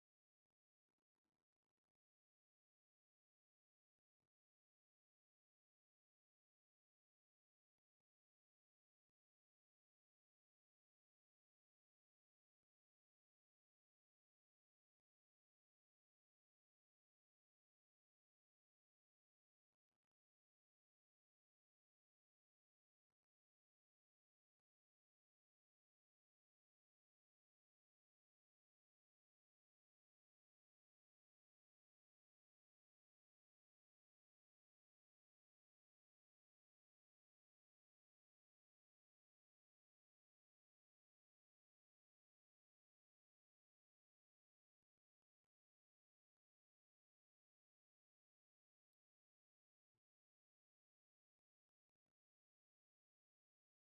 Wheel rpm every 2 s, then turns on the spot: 0, 0, 0, 0, 0, 0, 0, 0, 0, 0, 0, 0, 0, 0, 0, 0, 0, 0, 0, 0, 0, 0, 0, 0, 0, 0, 0.
none